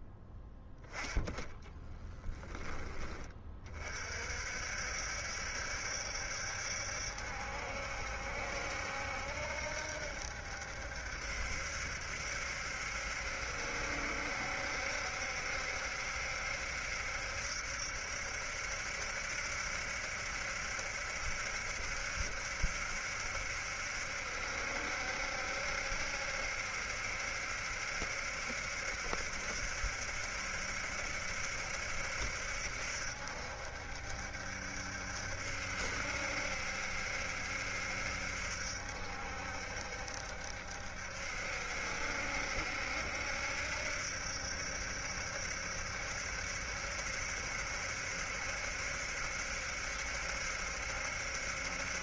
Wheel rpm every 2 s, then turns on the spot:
10, 20, 60, 70, 70, 70, 70, 70, 70, 70, 70, 70, 70, 70, 70, 70, 70, 70, 70, 70, 70, 70, 70, 70, 70, 70.
none